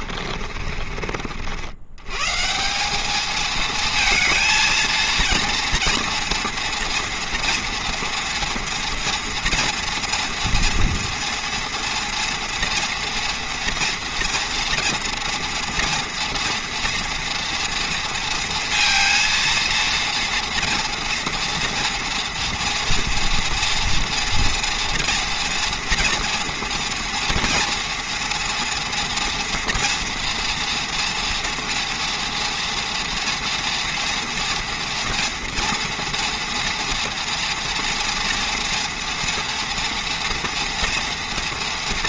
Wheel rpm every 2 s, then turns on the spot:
50, 160, 220, 230, 230, 230, 230, 230, 240, 230, 230, 230, 240, 230, 230, 230, 240, 230, 240, 230, 230.
0-2